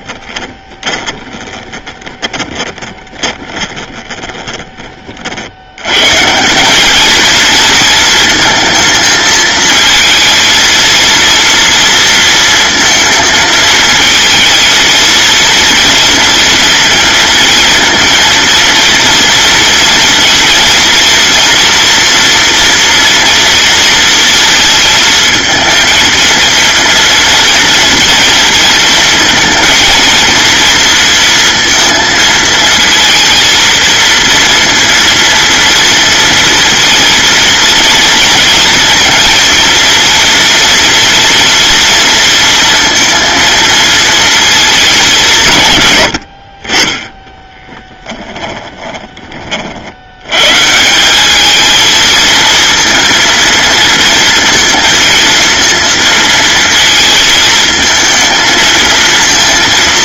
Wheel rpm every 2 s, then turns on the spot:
20, 10, 20, 210, 230, 230, 220, 230, 230, 230, 230, 240, 230, 230, 230, 230, 230, 230, 240, 230, 240, 230, 220, 40, 20, 130, 230, 230, 230, 220.
0-4 48-50